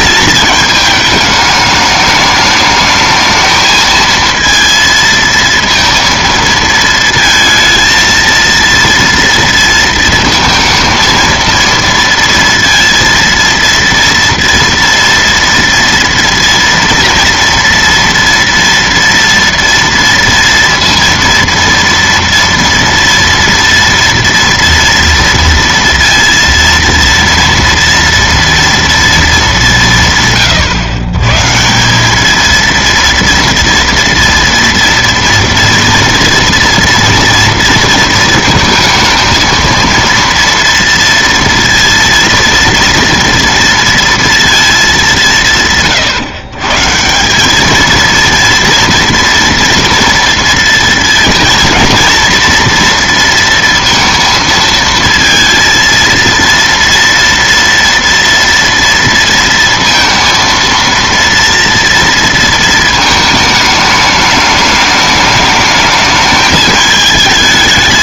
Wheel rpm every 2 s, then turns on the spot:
220, 210, 230, 230, 230, 220, 230, 230, 230, 230, 230, 230, 230, 230, 230, 110, 230, 230, 230, 220, 230, 230, 210, 140, 230, 230, 230, 230, 230, 230, 230, 230, 210, 220.
none